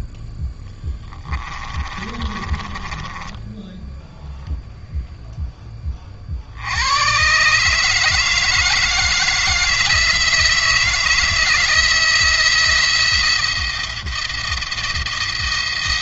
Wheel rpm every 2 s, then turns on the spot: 10, 20, 0, 90, 160, 160, 160, 170.
2-4